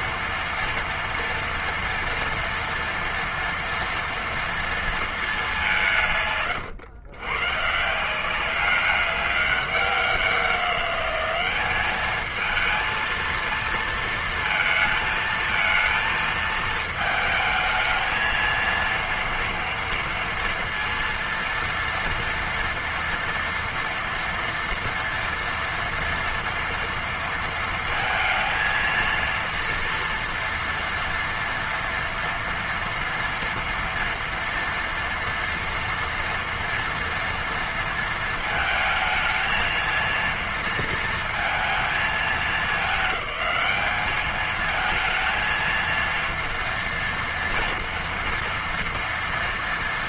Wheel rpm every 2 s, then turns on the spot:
230, 230, 230, 130, 190, 190, 220, 220, 220, 230, 230, 230, 230, 230, 230, 230, 230, 240, 230, 220, 230, 210, 220, 230, 240.
none